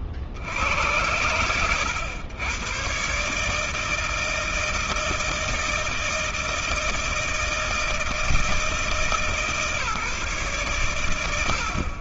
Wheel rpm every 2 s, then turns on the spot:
50, 100, 160, 160, 160, 140.
none